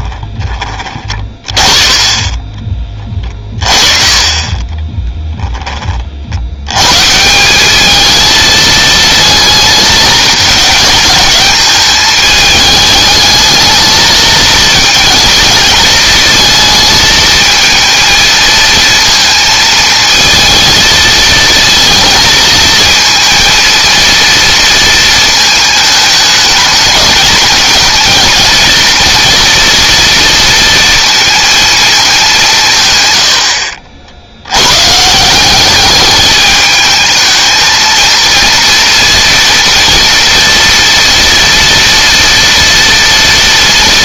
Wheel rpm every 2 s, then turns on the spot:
30, 20, 20, 110, 220, 210, 210, 220, 220, 230, 230, 220, 230, 210, 230, 230, 150, 110, 210, 230, 240, 230.
4-6